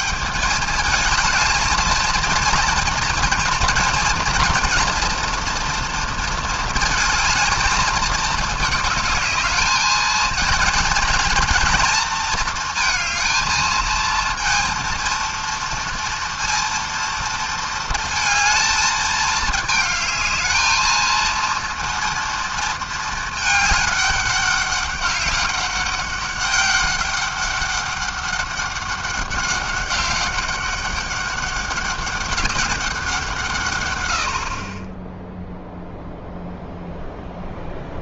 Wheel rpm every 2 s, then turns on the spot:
200, 230, 230, 230, 220, 230, 220, 230, 230, 220, 220, 230, 200, 200, 200, 200, 200, 50, 0.
none